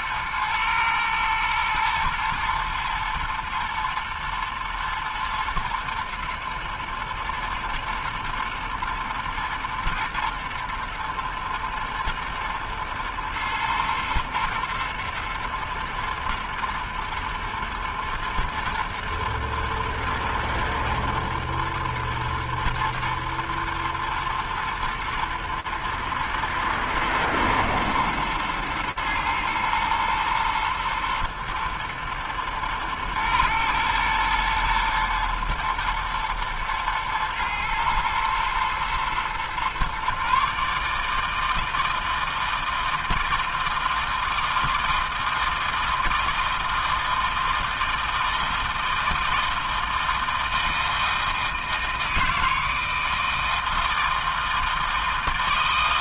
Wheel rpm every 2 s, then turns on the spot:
110, 110, 110, 110, 110, 120, 110, 120, 120, 110, 110, 110, 110, 120, 110, 110, 110, 120, 120, 110, 140, 160, 160, 160, 160, 160, 160, 160.
none